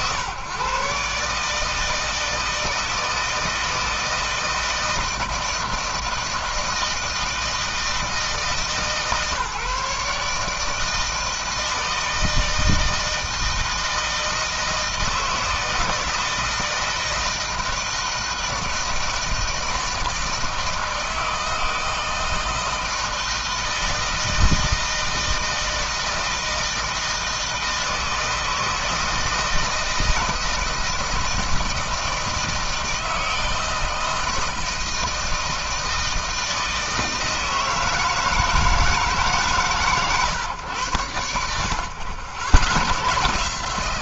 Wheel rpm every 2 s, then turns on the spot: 140, 160, 160, 160, 140, 160, 160, 160, 160, 160, 160, 160, 160, 160, 160, 160, 160, 160, 160, 150, 100, 110.
none